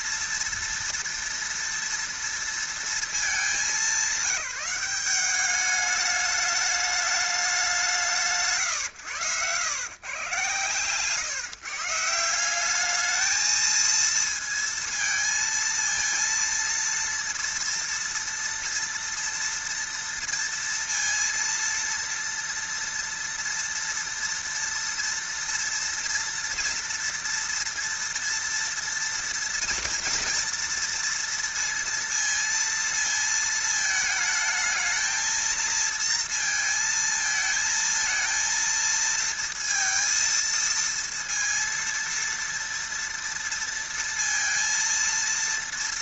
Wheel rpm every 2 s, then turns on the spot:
230, 230, 190, 210, 130, 120, 200, 230, 230, 230, 230, 230, 230, 230, 230, 240, 230, 220, 230, 230, 230, 230, 230.
8-10